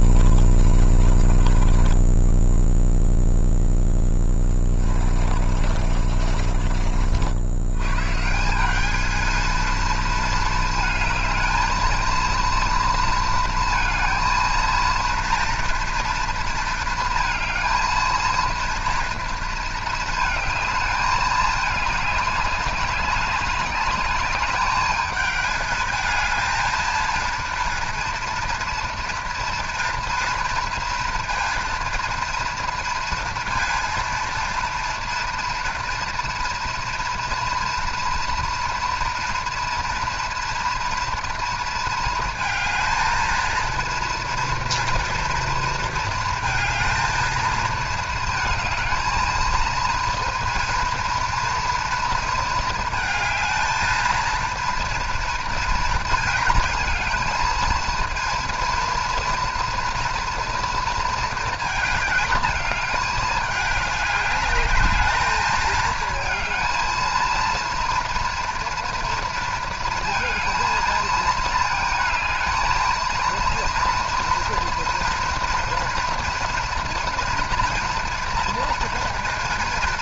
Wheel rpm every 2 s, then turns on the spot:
10, 20, 10, 50, 130, 230, 230, 220, 230, 230, 220, 210, 210, 220, 230, 230, 230, 230, 240, 230, 240, 220, 230, 220, 220, 230, 220, 230, 220, 230, 230, 210, 210, 230, 230, 230, 230, 230, 230, 240.
0-8